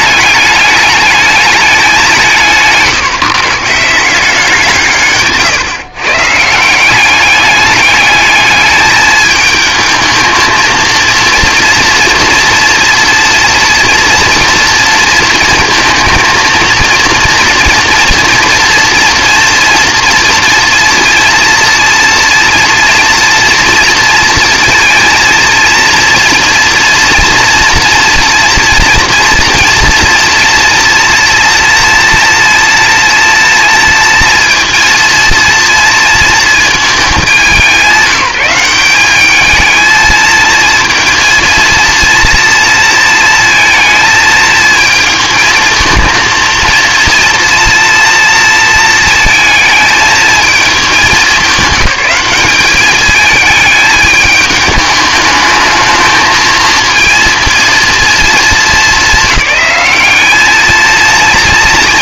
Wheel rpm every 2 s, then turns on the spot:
210, 160, 180, 170, 210, 220, 240, 230, 230, 240, 230, 240, 230, 230, 240, 230, 230, 230, 230, 190, 230, 230, 220, 230, 230, 220, 210, 210, 220, 220, 220.
none